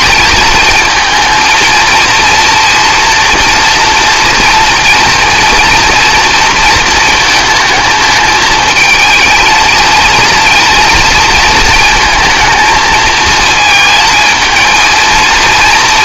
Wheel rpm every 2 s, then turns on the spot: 220, 230, 230, 230, 220, 230, 230, 220.
none